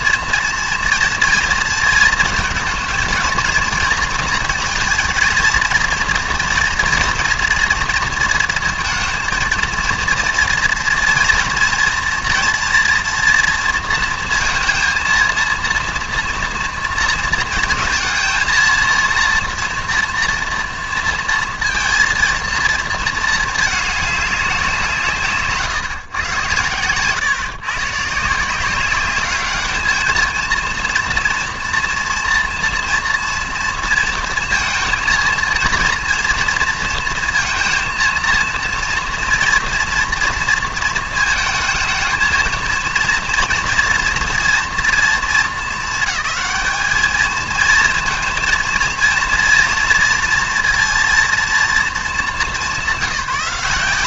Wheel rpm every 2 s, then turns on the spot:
230, 230, 230, 230, 220, 230, 230, 230, 230, 230, 230, 230, 190, 120, 170, 230, 240, 230, 230, 230, 230, 230, 230, 210, 230, 230, 200.
none